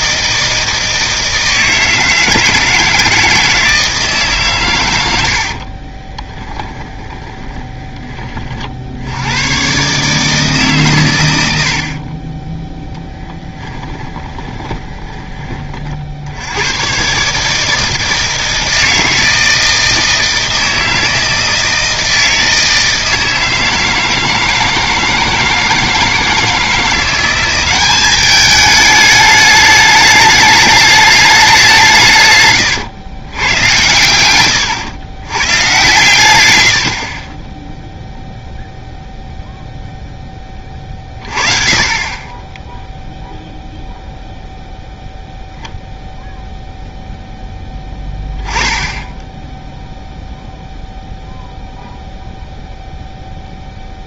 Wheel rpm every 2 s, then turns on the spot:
160, 160, 110, 10, 60, 130, 0, 20, 110, 160, 160, 160, 160, 170, 210, 210, 130, 100, 80, 0, 30, 10, 0, 0, 10, 0, 0.
6-8 14-16